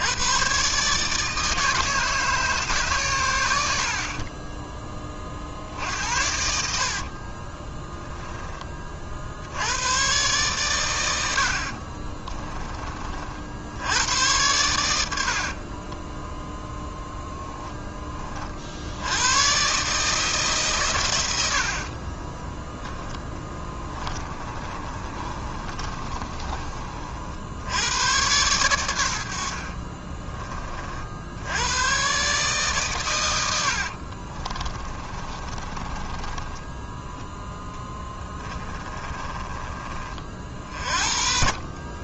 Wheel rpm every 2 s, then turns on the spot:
150, 120, 20, 50, 50, 100, 40, 80, 0, 80, 110, 10, 30, 50, 90, 60, 120, 30, 10, 20, 50.
6-8 22-26 34-36 38-42